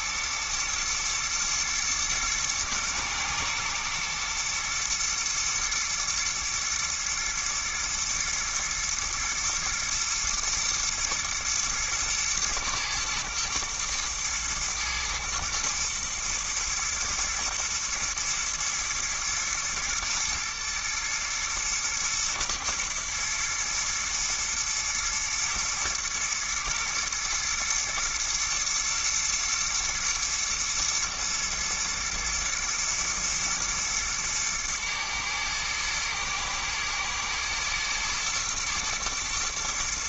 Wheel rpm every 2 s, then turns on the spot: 120, 110, 120, 120, 120, 110, 110, 110, 110, 110, 120, 120, 110, 110, 120, 110, 110, 110, 110, 110.
none